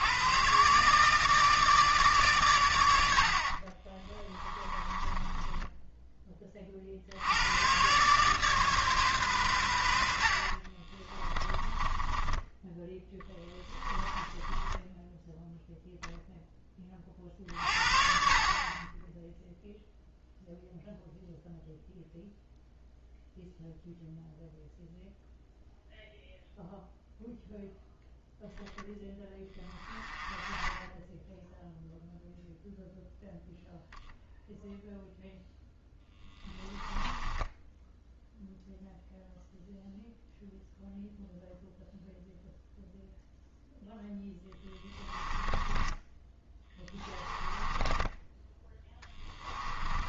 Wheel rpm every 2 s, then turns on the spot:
140, 90, 20, 50, 140, 30, 10, 10, 20, 20, 0, 0, 0, 0, 0, 10, 0, 0, 10, 0, 0, 0, 10, 10, 10.
4-6 10-16 36-38 44-50